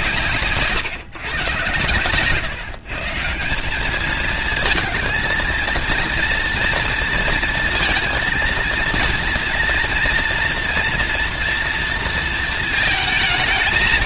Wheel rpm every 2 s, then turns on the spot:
110, 160, 230, 230, 230, 230, 220.
none